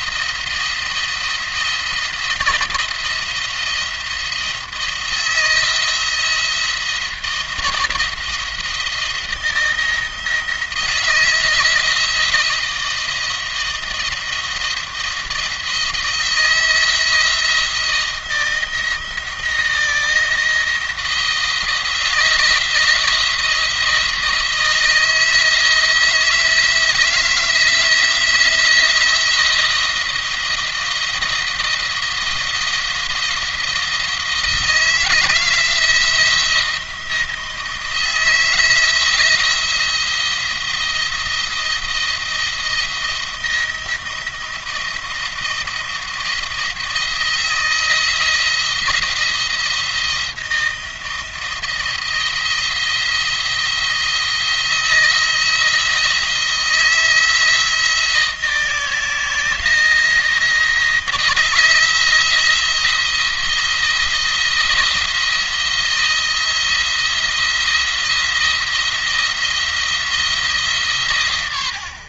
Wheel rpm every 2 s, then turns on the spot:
170, 170, 170, 170, 170, 160, 170, 170, 170, 160, 160, 170, 160, 160, 170, 170, 170, 160, 170, 170, 170, 170, 170, 160, 170, 160, 170, 160, 160, 160, 170, 170, 160, 170, 170, 140.
none